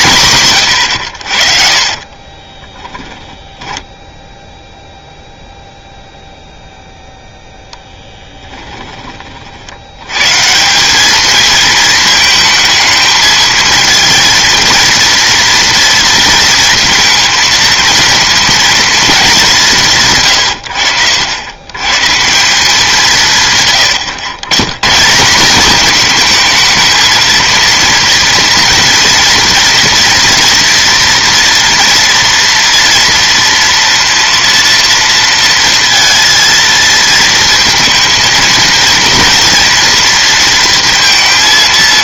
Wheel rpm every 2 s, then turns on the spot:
120, 20, 0, 0, 10, 170, 220, 230, 230, 230, 80, 180, 130, 220, 230, 230, 230, 230, 220, 230, 230.
2-4 8-10